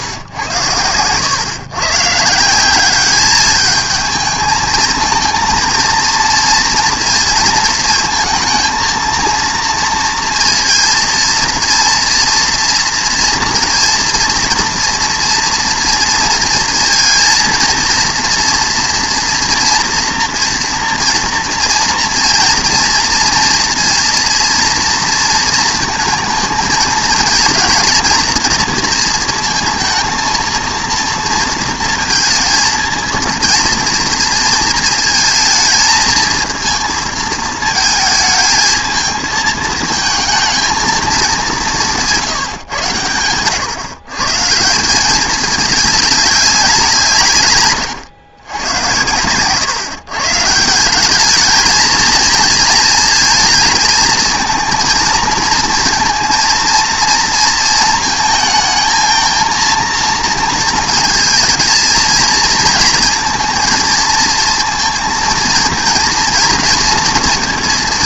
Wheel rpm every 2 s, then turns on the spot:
110, 200, 220, 230, 230, 230, 240, 240, 230, 240, 230, 230, 230, 220, 230, 230, 230, 220, 230, 220, 220, 120, 180, 170, 100, 180, 220, 230, 230, 220, 220, 230, 230, 230.
none